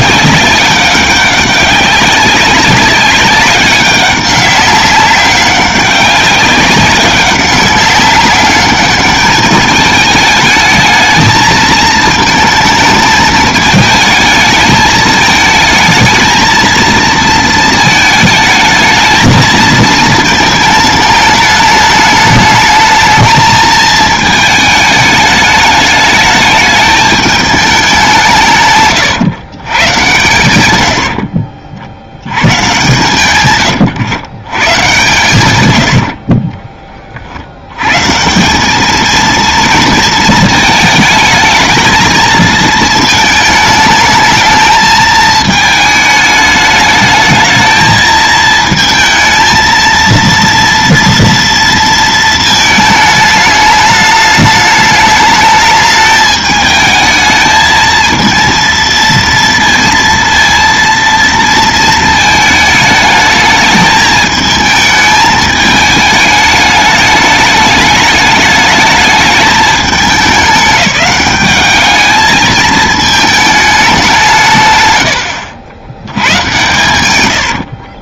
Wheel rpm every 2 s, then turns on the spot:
200, 200, 190, 190, 200, 220, 220, 220, 230, 220, 220, 220, 210, 210, 130, 90, 120, 120, 30, 210, 220, 220, 220, 210, 220, 230, 220, 210, 220, 230, 230, 220, 220, 210, 210, 200, 220, 120, 120.
28-30 32-34